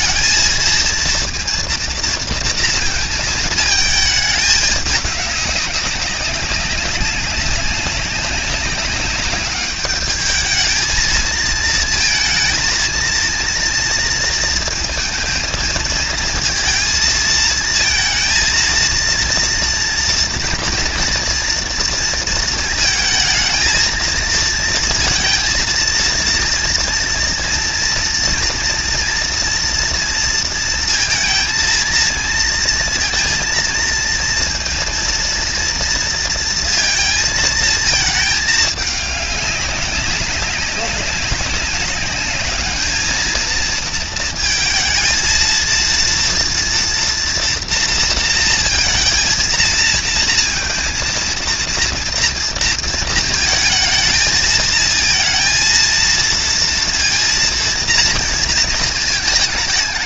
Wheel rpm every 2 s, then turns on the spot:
230, 230, 200, 200, 200, 220, 230, 230, 230, 230, 230, 230, 230, 230, 230, 230, 230, 230, 230, 210, 200, 220, 230, 240, 220, 230, 230, 220, 230, 220.
none